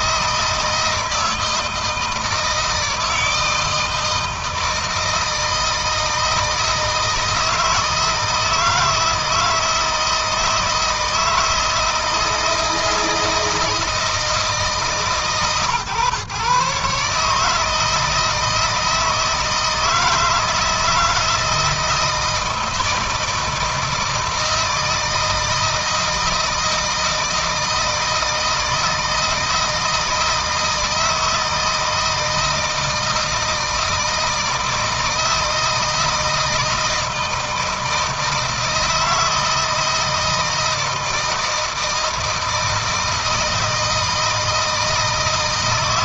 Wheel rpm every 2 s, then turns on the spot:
160, 160, 160, 160, 160, 160, 160, 150, 140, 160, 160, 160, 160, 160, 160, 160, 160, 160, 160, 160, 160, 160, 160.
none